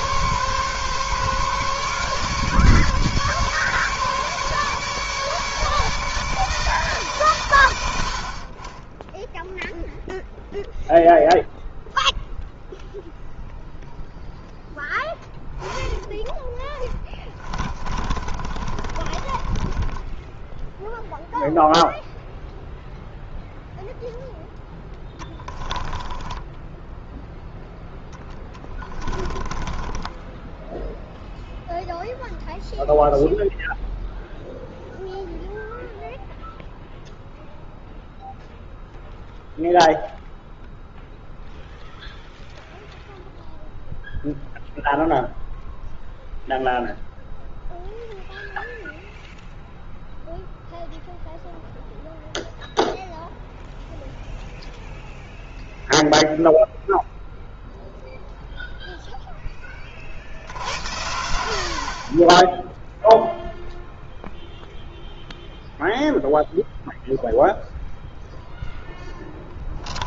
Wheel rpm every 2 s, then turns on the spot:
140, 150, 150, 150, 30, 0, 0, 10, 20, 30, 0, 0, 10, 10, 10, 10, 0, 0, 0, 0, 0, 0, 0, 0, 0, 0, 0, 0, 0, 0, 70, 10, 0, 0, 0.
16-20 26-32